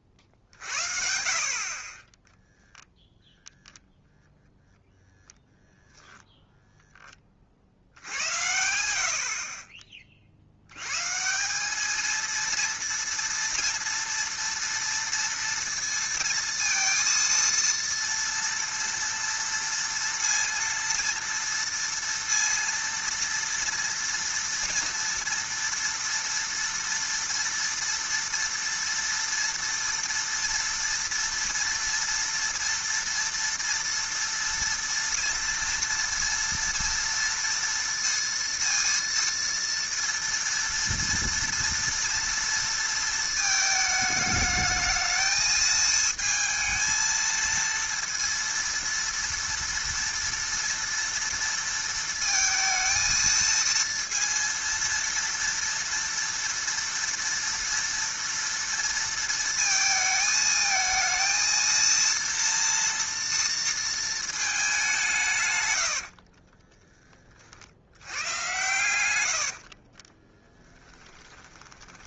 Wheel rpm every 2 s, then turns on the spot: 60, 0, 0, 0, 70, 90, 230, 230, 230, 230, 230, 230, 230, 230, 230, 240, 230, 230, 230, 230, 230, 230, 210, 220, 230, 230, 220, 230, 230, 230, 220, 230, 210, 20, 110, 20.
66-68 70-72